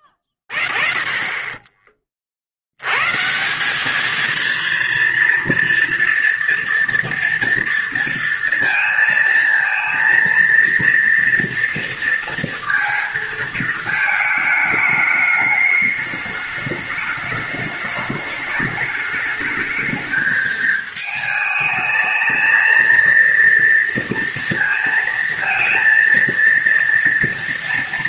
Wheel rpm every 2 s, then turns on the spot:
10, 70, 230, 230, 230, 230, 230, 210, 210, 210, 220, 230, 230, 230.
0-2